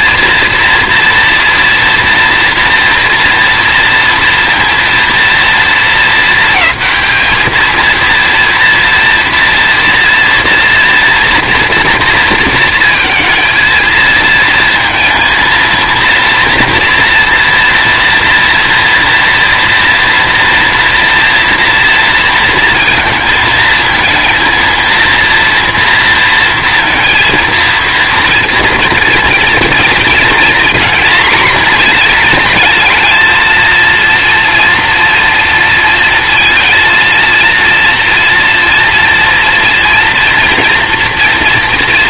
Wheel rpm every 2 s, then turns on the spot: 230, 230, 230, 220, 230, 230, 230, 230, 230, 230, 230, 230, 230, 230, 230, 230, 220, 230, 230, 230, 230.
none